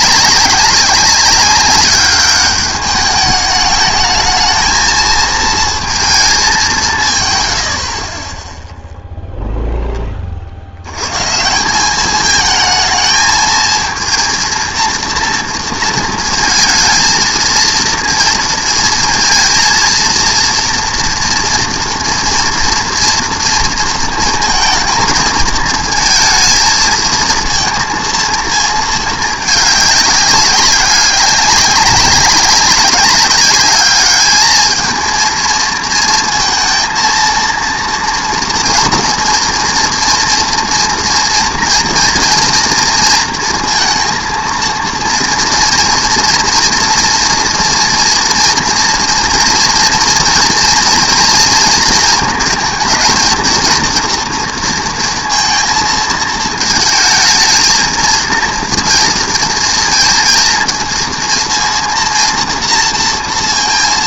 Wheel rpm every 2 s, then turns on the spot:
190, 200, 220, 180, 0, 70, 220, 230, 230, 230, 230, 230, 220, 220, 230, 200, 190, 220, 230, 230, 230, 230, 230, 230, 230, 230, 230, 230, 220, 230, 230, 230.
none